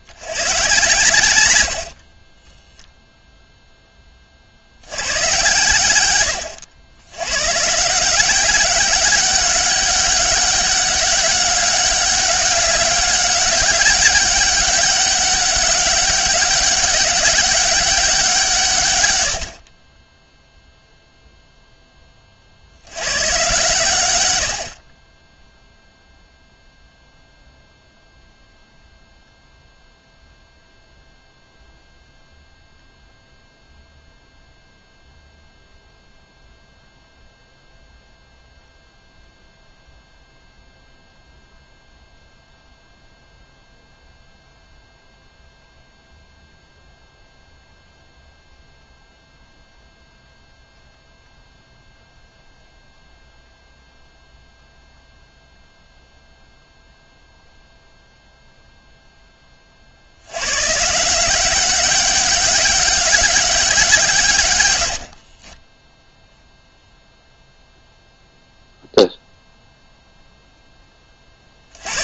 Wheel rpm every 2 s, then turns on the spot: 110, 0, 100, 100, 200, 200, 200, 200, 200, 120, 0, 90, 40, 0, 0, 0, 0, 0, 0, 0, 0, 0, 0, 0, 0, 0, 0, 0, 0, 0, 150, 200, 80, 0, 0, 20.
none